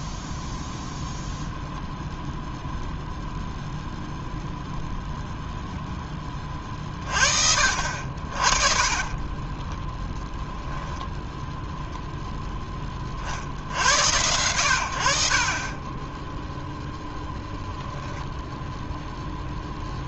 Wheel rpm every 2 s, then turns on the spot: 0, 0, 0, 30, 40, 0, 10, 90, 0, 0.
none